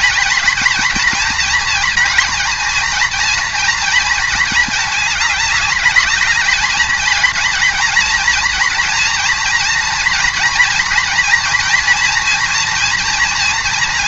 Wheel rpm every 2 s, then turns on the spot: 220, 230, 220, 210, 230, 230, 230.
none